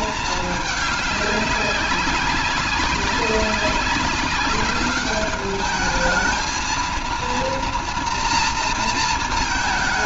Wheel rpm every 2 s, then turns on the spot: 200, 200, 210, 230, 220.
none